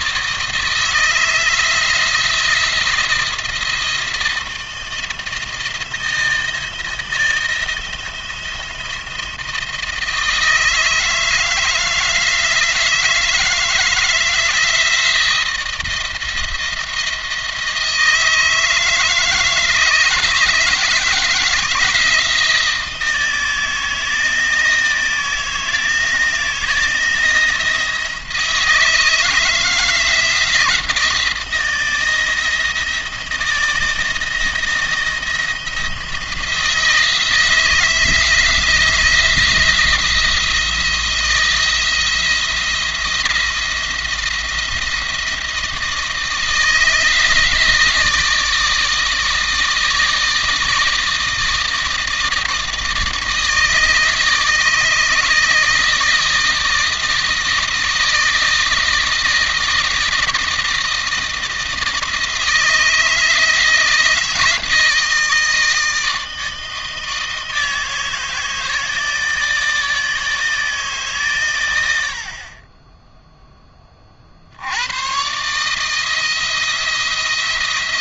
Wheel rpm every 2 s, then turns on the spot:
160, 170, 170, 160, 170, 160, 160, 170, 170, 160, 160, 170, 160, 170, 170, 170, 170, 170, 160, 170, 170, 170, 170, 160, 160, 160, 160, 160, 160, 160, 160, 160, 160, 160, 160, 160, 30, 80, 170.
none